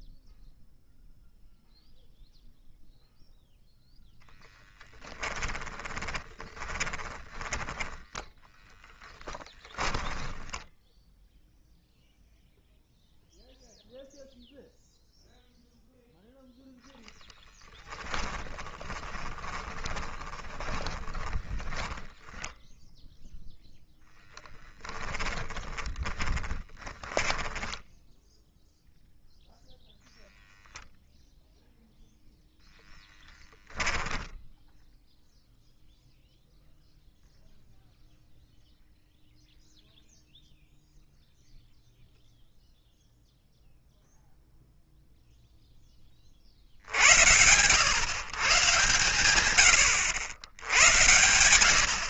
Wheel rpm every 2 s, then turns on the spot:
0, 0, 10, 20, 10, 10, 0, 0, 0, 10, 20, 10, 10, 10, 0, 0, 10, 0, 0, 0, 0, 0, 0, 70, 110, 90.
4-10 18-22 24-28 32-34